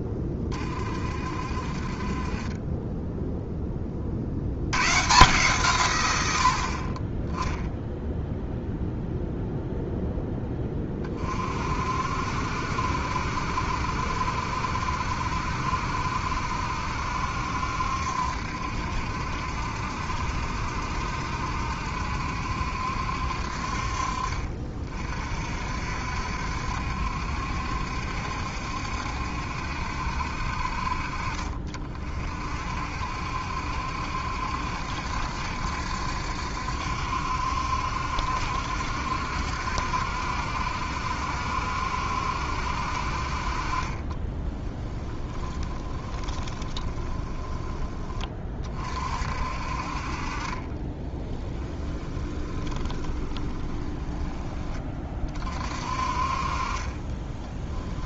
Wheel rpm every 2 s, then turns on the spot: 30, 10, 110, 40, 0, 20, 70, 70, 70, 70, 70, 70, 40, 70, 70, 50, 60, 70, 70, 70, 70, 60, 20, 10, 40, 30, 20, 20, 30.
44-48 50-54 56-58